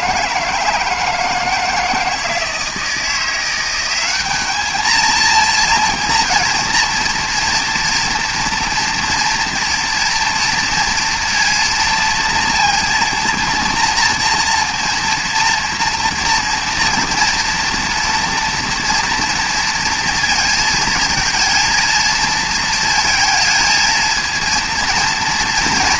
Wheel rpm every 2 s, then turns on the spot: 160, 170, 230, 230, 230, 230, 230, 230, 230, 230, 220, 220, 230.
none